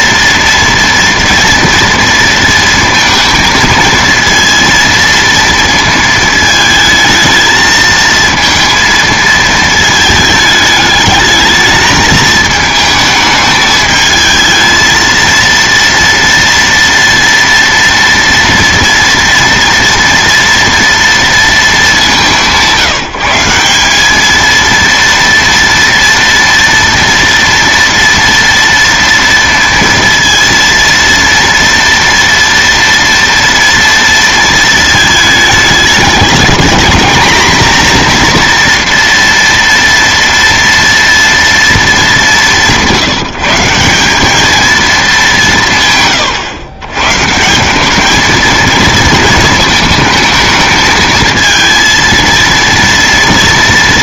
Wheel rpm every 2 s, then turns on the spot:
240, 230, 230, 220, 230, 220, 220, 230, 230, 230, 230, 170, 230, 230, 230, 230, 230, 220, 220, 240, 230, 170, 200, 120, 220, 220, 230.
none